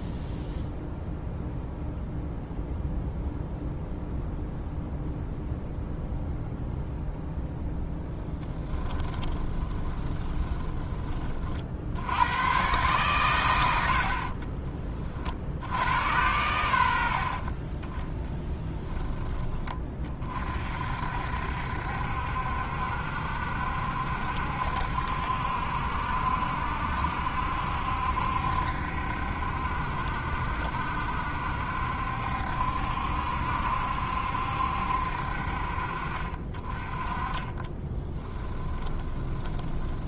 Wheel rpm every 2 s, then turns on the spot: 0, 0, 0, 0, 20, 10, 120, 20, 80, 10, 50, 70, 70, 70, 70, 70, 70, 70, 30, 20.
8-10 14-16 38-40